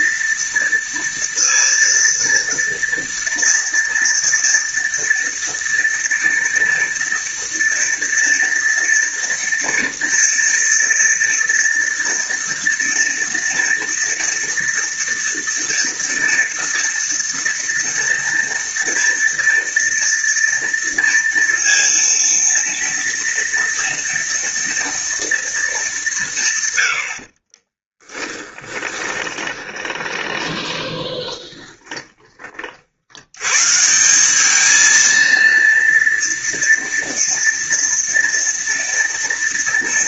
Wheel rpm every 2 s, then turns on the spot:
230, 230, 230, 230, 230, 230, 230, 230, 230, 230, 230, 230, 230, 120, 20, 20, 70, 220, 230, 240.
28-32